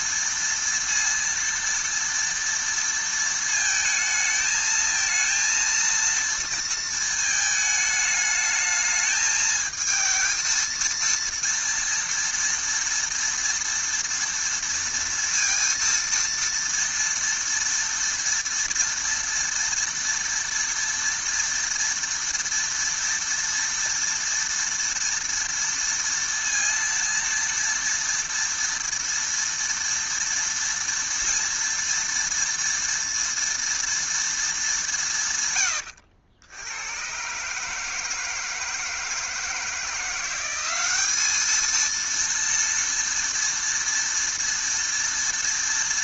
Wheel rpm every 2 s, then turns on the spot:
230, 230, 220, 230, 220, 230, 230, 230, 230, 230, 230, 240, 230, 230, 230, 230, 230, 210, 90, 160, 190, 230, 230.
none